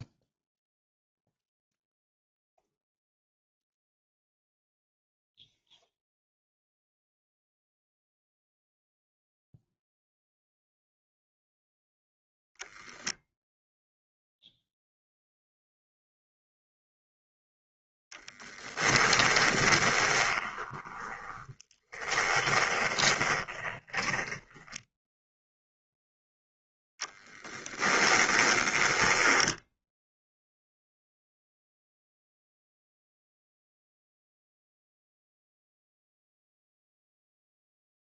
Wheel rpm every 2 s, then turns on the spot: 0, 0, 0, 0, 0, 0, 0, 0, 0, 10, 20, 20, 10, 10, 20, 0, 0, 0, 0.
18-26 28-30